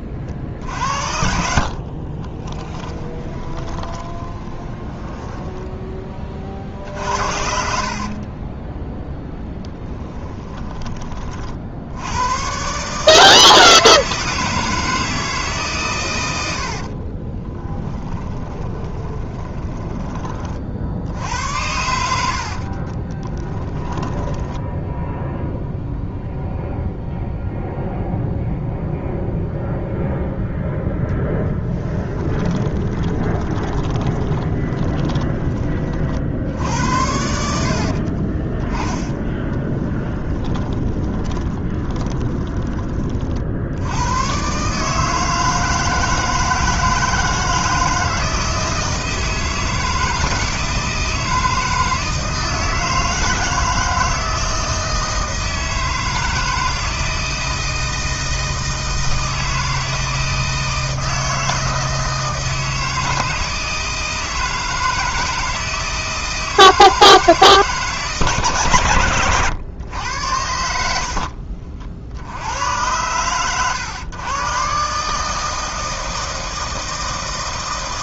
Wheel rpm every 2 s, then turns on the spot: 60, 20, 20, 50, 10, 20, 140, 160, 60, 20, 50, 30, 10, 0, 0, 0, 20, 20, 80, 20, 20, 20, 140, 160, 160, 160, 160, 160, 160, 160, 160, 160, 160, 160, 120, 80, 110, 140, 160.
2-10 16-20 22-26 32-38 40-42 70-72